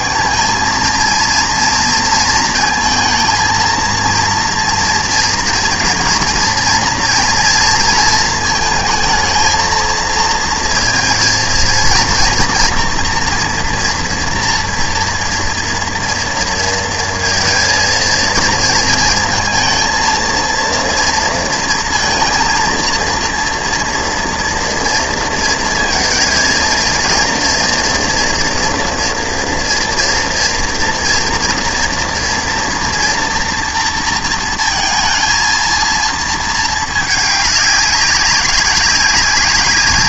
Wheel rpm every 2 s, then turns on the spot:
220, 220, 230, 230, 220, 230, 230, 230, 230, 230, 230, 230, 230, 230, 230, 230, 230, 230, 220, 200.
none